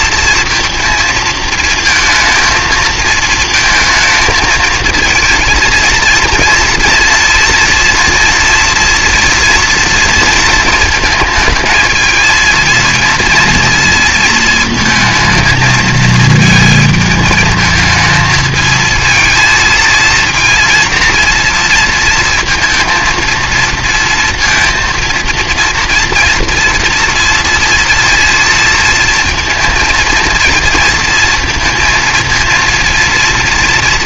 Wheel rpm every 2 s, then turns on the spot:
230, 230, 220, 230, 230, 230, 220, 230, 220, 220, 230, 230, 230, 240, 230, 220, 230.
none